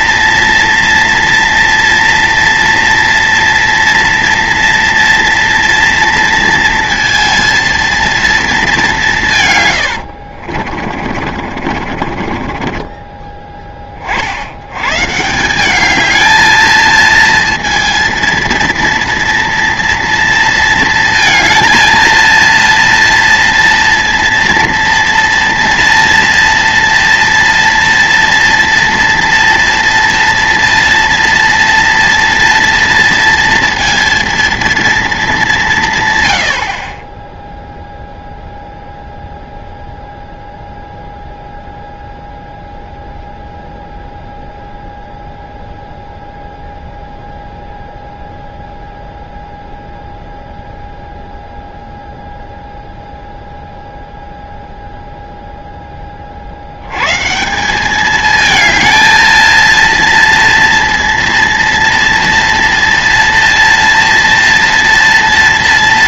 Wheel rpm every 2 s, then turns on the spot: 230, 230, 230, 230, 210, 50, 30, 90, 220, 230, 230, 230, 230, 230, 230, 230, 230, 230, 80, 0, 0, 0, 0, 0, 0, 0, 0, 0, 60, 220, 230, 230, 230.
10-14